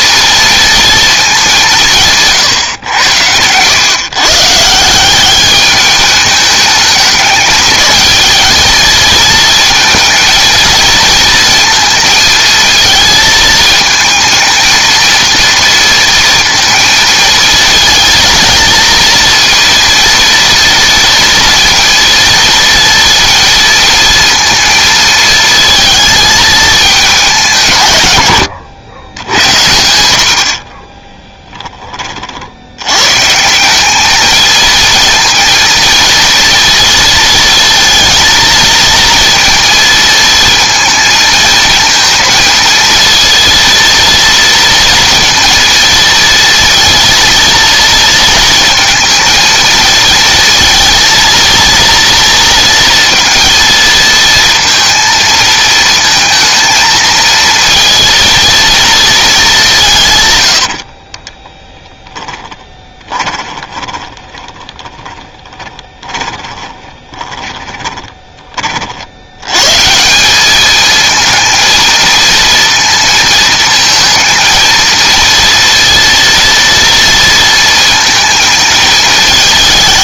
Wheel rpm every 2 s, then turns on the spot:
230, 120, 160, 210, 220, 230, 230, 230, 230, 230, 230, 230, 230, 220, 100, 40, 90, 230, 230, 230, 220, 230, 230, 230, 230, 230, 230, 230, 230, 230, 80, 20, 20, 20, 40, 210, 230, 230, 230, 220.
28-32 60-68